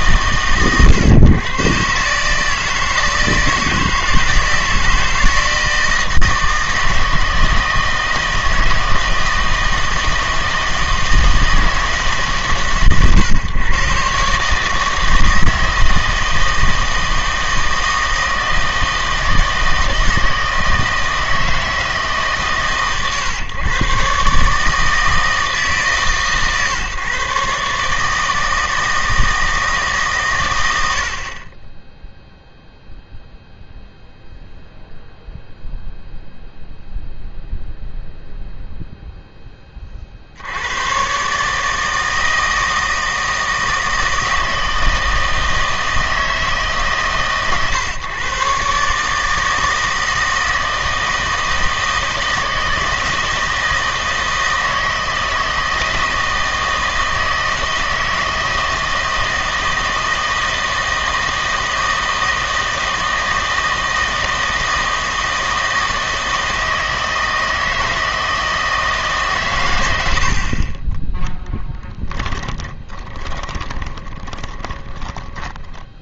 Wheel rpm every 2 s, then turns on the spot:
130, 160, 160, 160, 160, 160, 130, 150, 160, 160, 160, 140, 150, 130, 160, 90, 0, 0, 0, 0, 90, 160, 160, 150, 140, 160, 160, 160, 160, 160, 160, 160, 160, 160, 160, 40, 20, 20.
72-76